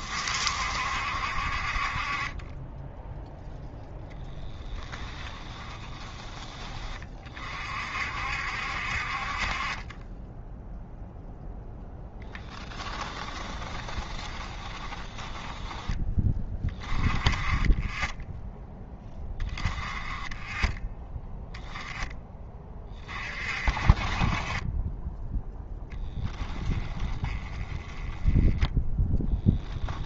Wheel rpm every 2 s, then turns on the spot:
60, 10, 10, 20, 60, 0, 10, 20, 20, 10, 10, 30, 10, 10, 10.
4-6 12-16